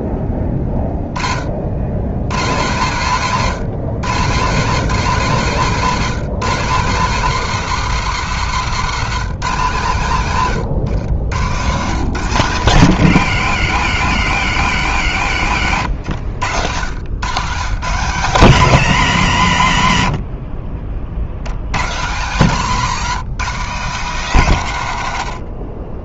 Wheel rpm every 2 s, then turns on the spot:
190, 210, 210, 140, 160, 140, 90, 190, 70, 150, 170, 10, 100.
none